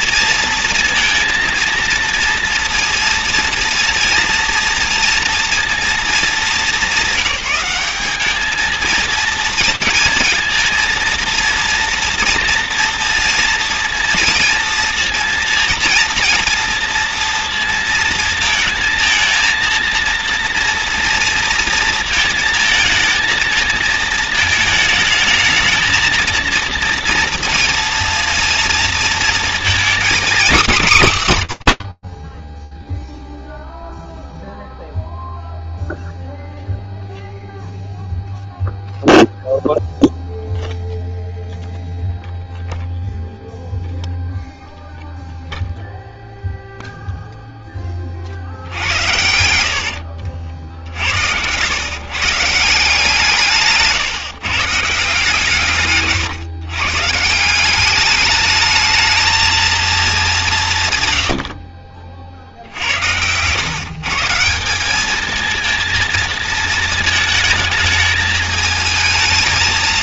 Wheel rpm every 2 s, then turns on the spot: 230, 230, 230, 210, 220, 230, 230, 230, 230, 230, 230, 220, 220, 230, 230, 250, 0, 0, 0, 0, 0, 0, 0, 20, 80, 130, 140, 130, 200, 220, 50, 140, 220, 220, 220.
48-50